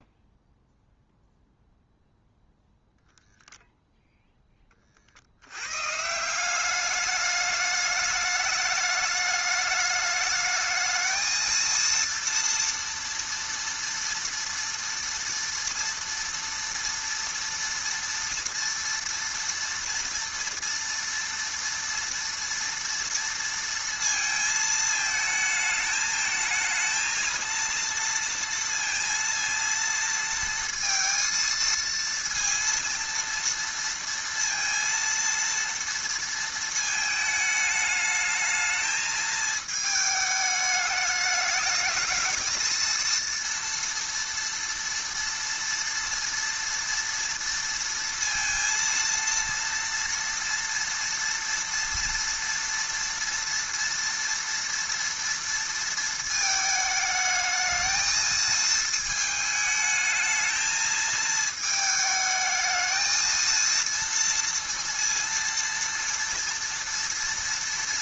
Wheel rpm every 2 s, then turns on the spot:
0, 0, 20, 190, 210, 220, 230, 230, 230, 240, 230, 230, 220, 220, 230, 230, 230, 230, 220, 220, 210, 220, 230, 230, 230, 230, 230, 230, 220, 220, 220, 220, 230, 230.
none